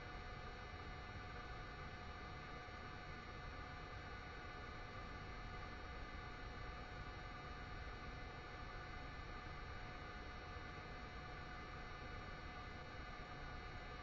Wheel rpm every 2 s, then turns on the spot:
0, 0, 0, 0, 0, 0, 0.
none